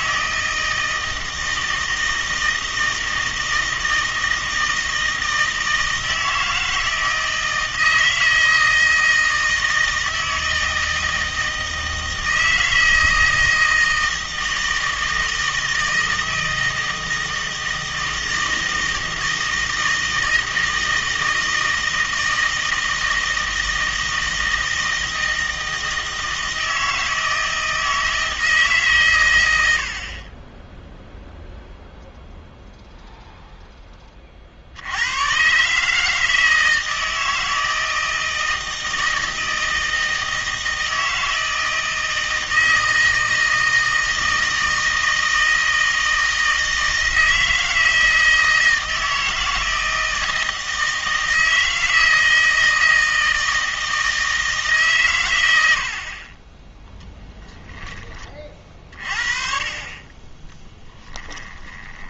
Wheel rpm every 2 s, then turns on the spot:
160, 160, 160, 160, 160, 160, 160, 160, 160, 160, 160, 160, 160, 160, 150, 10, 0, 70, 160, 160, 160, 160, 160, 160, 160, 160, 160, 150, 10, 40, 10.
60-62